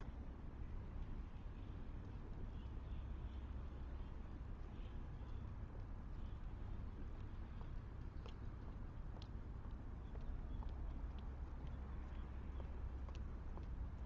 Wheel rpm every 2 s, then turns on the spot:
0, 0, 0, 0, 0, 0, 0.
none